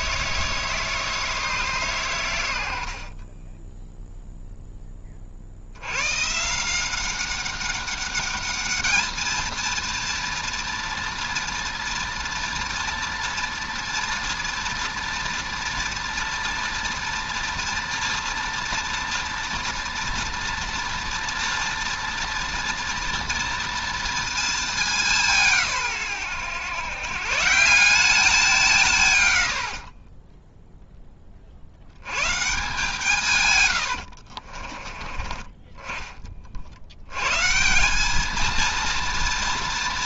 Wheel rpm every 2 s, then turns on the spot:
160, 70, 10, 170, 220, 240, 240, 240, 240, 230, 230, 230, 210, 120, 150, 10, 160, 30, 70, 230.
none